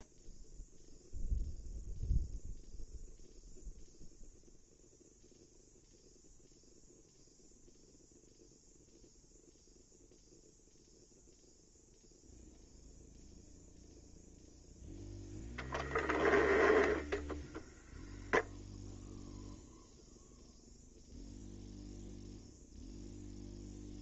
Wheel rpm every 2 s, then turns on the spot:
0, 0, 0, 0, 0, 0, 0, 0, 10, 0, 0, 0.
16-18